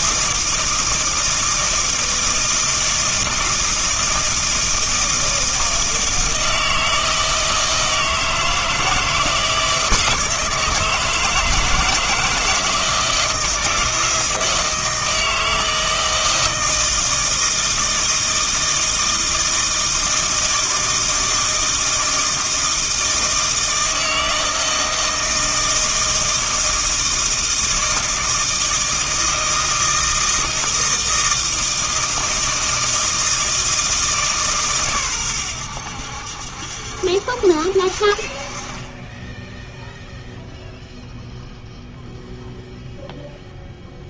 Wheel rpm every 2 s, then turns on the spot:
160, 160, 160, 160, 160, 160, 170, 160, 160, 160, 160, 160, 160, 160, 160, 160, 160, 130, 70, 30, 0, 0.
none